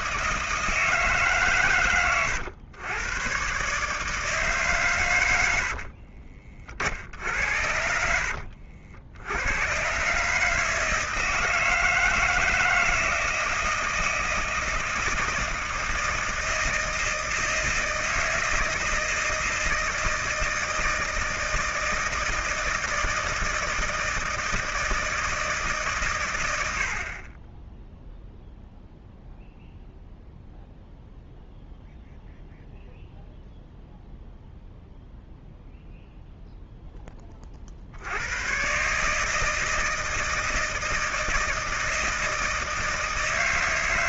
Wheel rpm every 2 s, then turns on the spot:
160, 110, 140, 60, 70, 160, 160, 160, 160, 160, 160, 160, 160, 60, 0, 0, 0, 0, 0, 130, 160, 160.
none